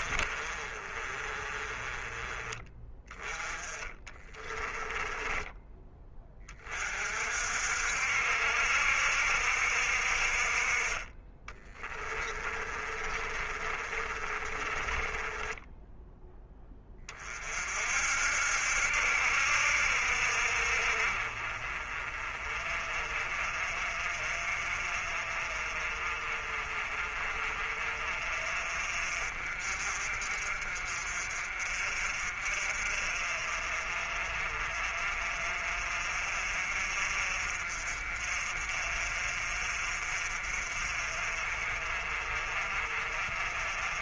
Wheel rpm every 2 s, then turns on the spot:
30, 20, 20, 30, 70, 40, 30, 20, 20, 70, 50, 40, 40, 40, 40, 50, 50, 40, 50, 40, 40, 40.
0-2 4-6 12-16